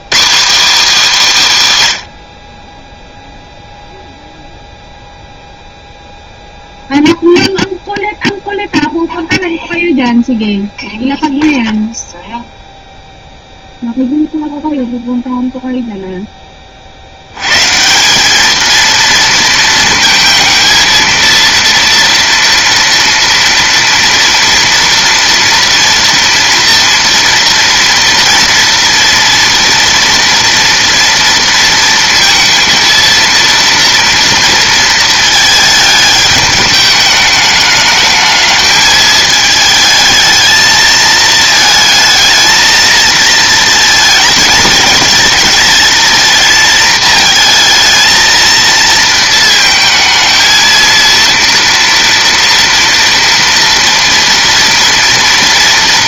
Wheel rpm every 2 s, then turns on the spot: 250, 10, 0, 0, 0, 0, 0, 0, 60, 220, 230, 240, 230, 230, 240, 230, 230, 220, 210, 220, 220, 230, 220, 230, 220, 230, 230, 230.
none